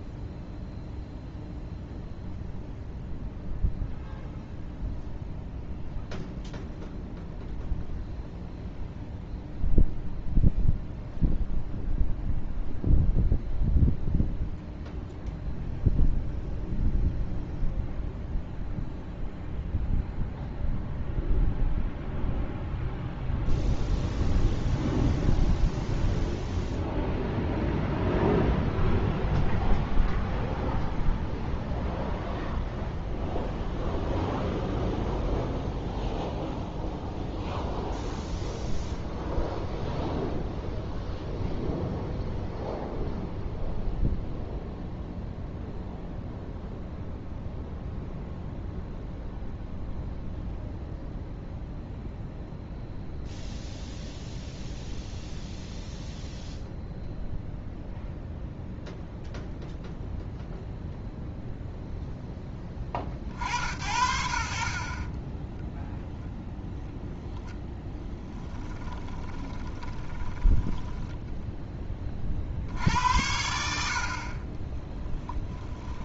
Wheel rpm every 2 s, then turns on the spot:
0, 0, 0, 0, 0, 0, 0, 0, 0, 0, 0, 0, 0, 0, 0, 0, 0, 0, 0, 0, 0, 0, 0, 0, 0, 0, 0, 0, 0, 0, 0, 20, 40, 0, 20, 10, 60, 10.
68-72 74-76